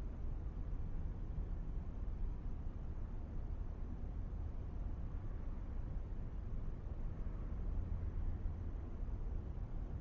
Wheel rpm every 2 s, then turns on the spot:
0, 0, 0, 0, 0.
none